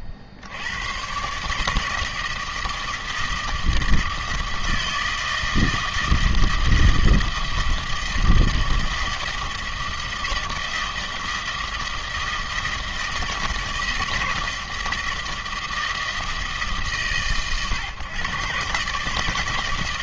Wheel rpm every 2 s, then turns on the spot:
50, 160, 160, 160, 160, 160, 160, 160, 160, 140.
none